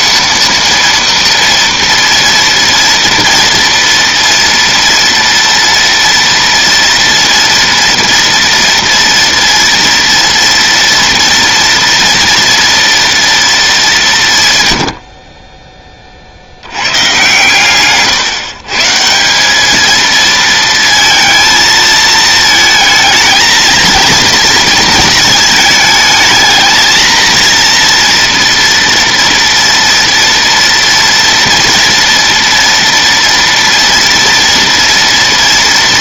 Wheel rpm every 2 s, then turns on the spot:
230, 230, 230, 230, 230, 230, 230, 90, 120, 140, 230, 220, 230, 220, 230, 230, 230, 230.
none